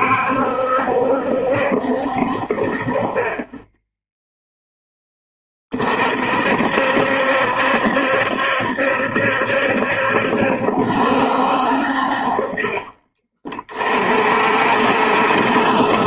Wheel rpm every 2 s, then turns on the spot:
70, 40, 0, 60, 70, 70, 40, 50.
none